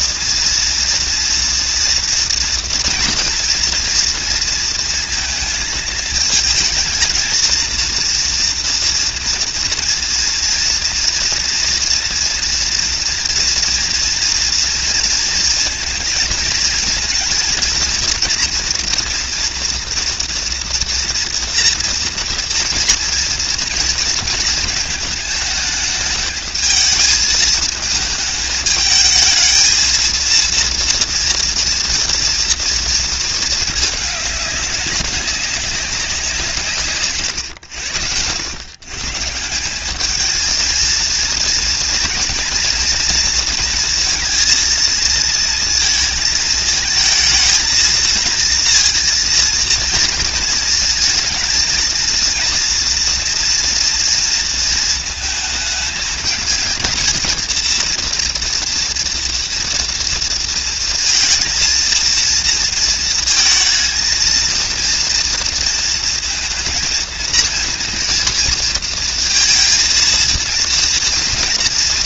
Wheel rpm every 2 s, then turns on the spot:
230, 230, 230, 230, 230, 230, 240, 230, 230, 230, 230, 230, 220, 220, 220, 230, 230, 200, 140, 140, 220, 230, 230, 220, 230, 230, 230, 230, 220, 230, 220, 230, 230, 230, 230, 230.
none